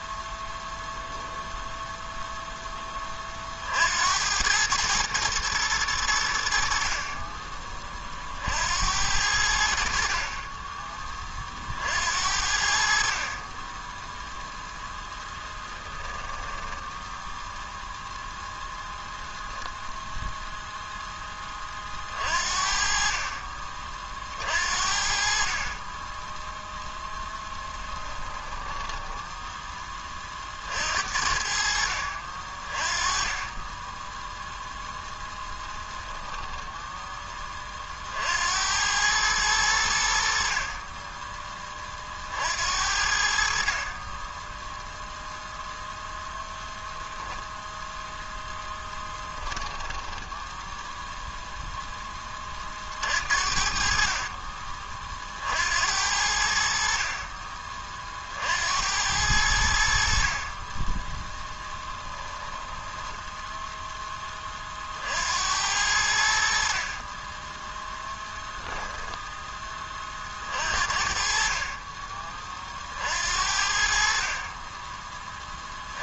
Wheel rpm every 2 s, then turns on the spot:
0, 20, 110, 50, 80, 30, 50, 0, 10, 0, 0, 40, 50, 0, 10, 60, 30, 0, 10, 100, 30, 70, 0, 10, 10, 0, 40, 40, 50, 80, 10, 10, 50, 30, 10, 50, 50, 20.
16-18 28-30 48-50 62-64